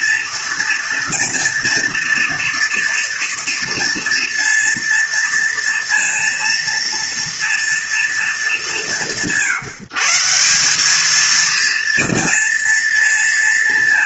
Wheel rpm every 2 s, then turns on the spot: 230, 230, 230, 230, 190, 200, 230.
none